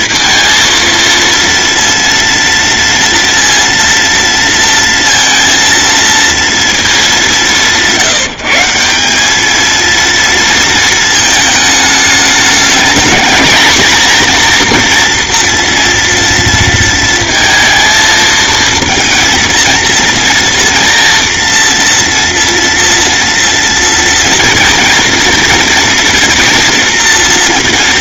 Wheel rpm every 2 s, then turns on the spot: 230, 230, 230, 220, 190, 220, 220, 240, 230, 230, 230, 230, 230, 230.
none